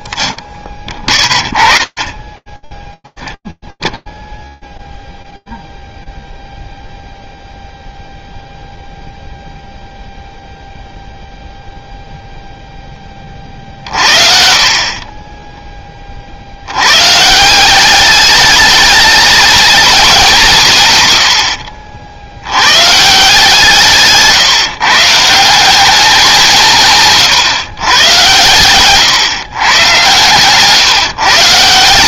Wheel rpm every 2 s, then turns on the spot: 20, 0, 0, 0, 0, 0, 30, 20, 190, 220, 70, 160, 180, 140, 120, 110.
30-32